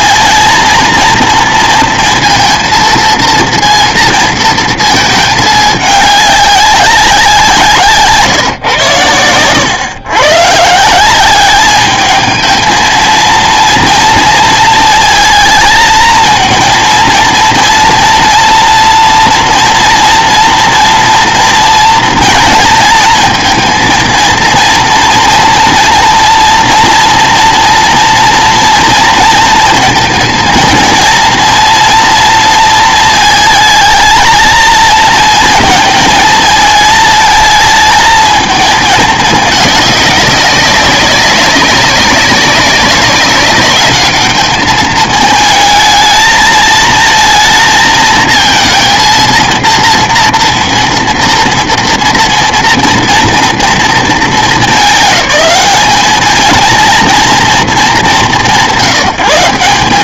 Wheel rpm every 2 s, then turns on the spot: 230, 230, 220, 190, 130, 150, 220, 230, 230, 230, 230, 230, 230, 230, 230, 230, 230, 220, 220, 220, 190, 200, 210, 220, 230, 230, 230, 190, 230, 160.
none